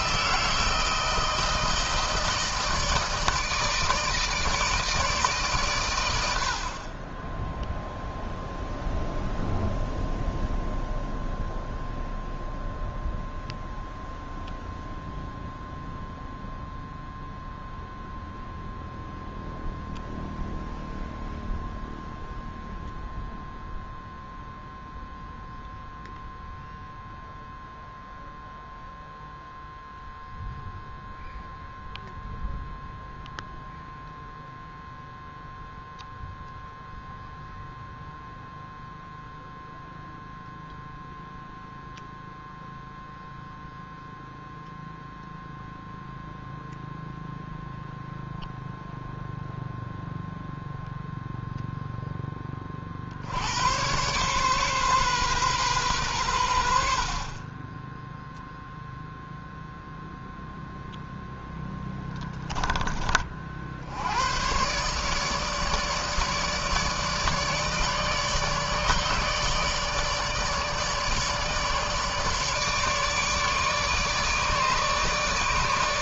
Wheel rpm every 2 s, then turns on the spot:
160, 160, 150, 80, 0, 0, 0, 0, 0, 0, 0, 0, 0, 0, 0, 0, 0, 0, 0, 0, 0, 0, 0, 0, 0, 0, 20, 130, 90, 0, 0, 10, 100, 150, 150, 160, 150, 150.
none